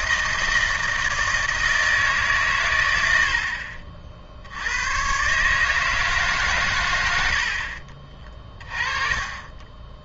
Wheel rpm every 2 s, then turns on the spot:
160, 110, 90, 110, 30.
none